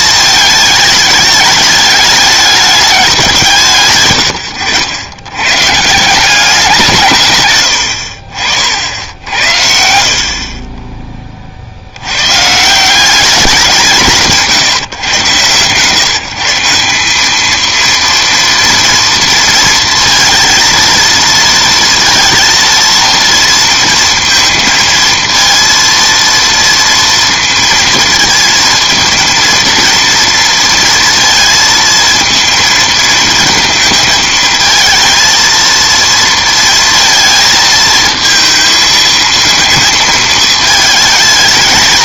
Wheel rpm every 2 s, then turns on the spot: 210, 210, 100, 180, 70, 30, 140, 150, 170, 230, 230, 230, 230, 230, 230, 230, 230, 220, 230, 220, 220.
10-12